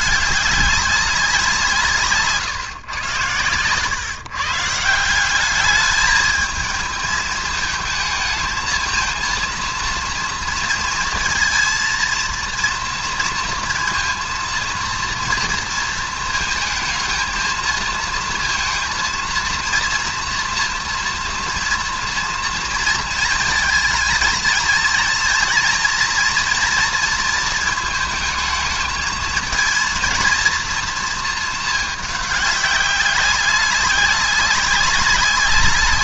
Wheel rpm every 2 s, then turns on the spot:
210, 130, 140, 220, 220, 230, 230, 230, 220, 230, 240, 230, 220, 230, 220, 230, 200, 200.
none